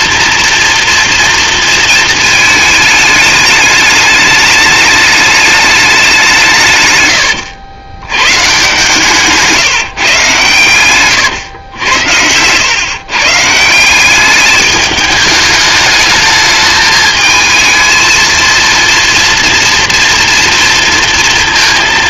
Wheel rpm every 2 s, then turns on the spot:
230, 220, 210, 140, 150, 130, 110, 210, 210, 230, 230.
none